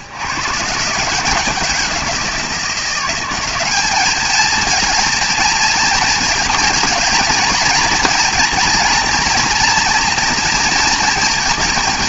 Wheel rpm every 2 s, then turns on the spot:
150, 180, 220, 220, 230, 230.
none